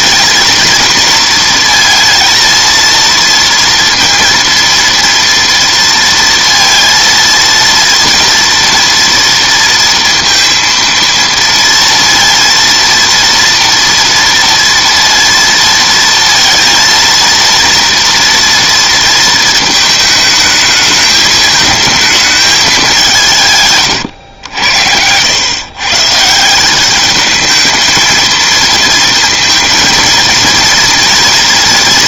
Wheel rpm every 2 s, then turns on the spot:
230, 230, 230, 230, 230, 230, 230, 230, 230, 230, 220, 210, 90, 190, 220, 230.
none